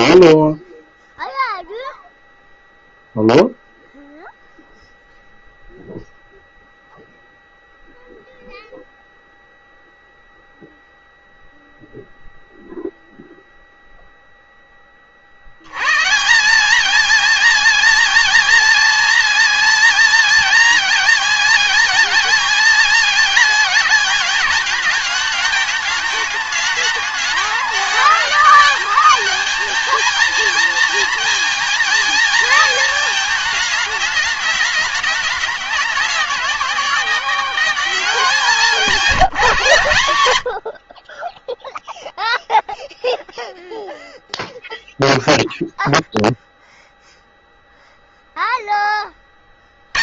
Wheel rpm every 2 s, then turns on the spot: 0, 0, 0, 0, 0, 0, 0, 0, 170, 230, 230, 220, 210, 220, 220, 220, 220, 210, 180, 200, 100, 0, 0, 0, 0.
none